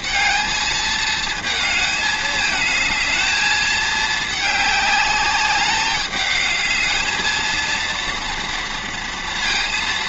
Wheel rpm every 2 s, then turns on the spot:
230, 220, 210, 220, 240.
none